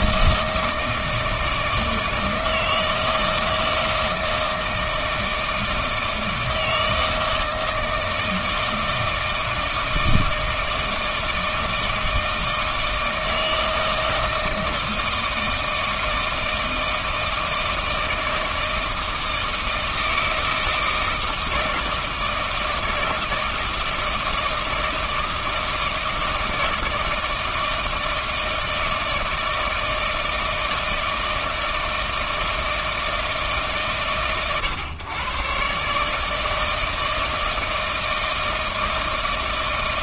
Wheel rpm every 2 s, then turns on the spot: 160, 160, 160, 160, 160, 160, 160, 160, 160, 160, 160, 160, 160, 160, 160, 160, 160, 110, 160, 160.
none